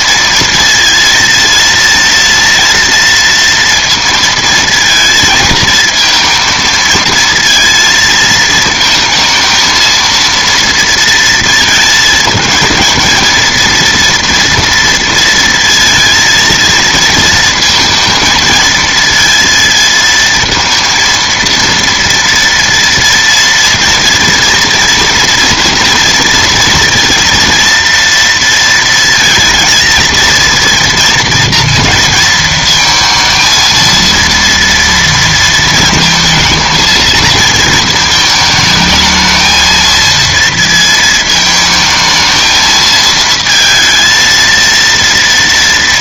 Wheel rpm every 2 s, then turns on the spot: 230, 230, 230, 230, 220, 230, 230, 230, 220, 220, 230, 230, 230, 230, 230, 230, 230, 230, 230, 220, 220, 220, 230.
none